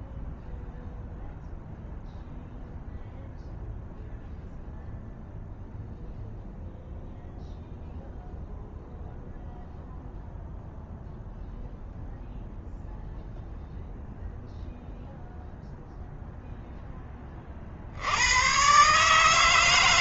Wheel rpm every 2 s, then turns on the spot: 0, 0, 0, 0, 0, 0, 0, 0, 10, 130.
none